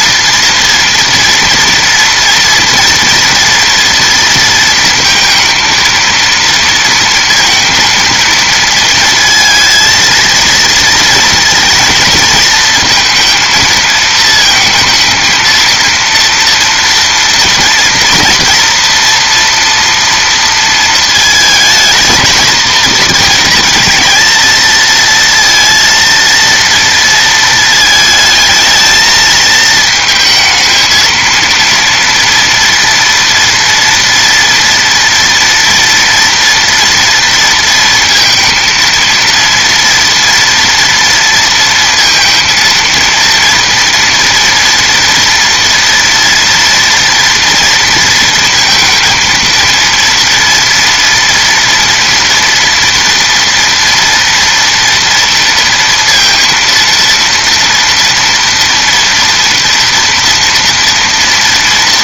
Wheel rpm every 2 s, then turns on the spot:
230, 230, 230, 230, 230, 230, 230, 220, 230, 230, 230, 230, 220, 230, 220, 220, 230, 230, 240, 230, 230, 230, 230, 230, 230, 230, 230, 230, 230, 230, 230.
none